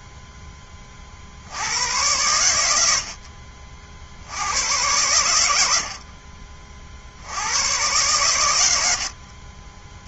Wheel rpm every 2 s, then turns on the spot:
10, 100, 80, 40, 110.
none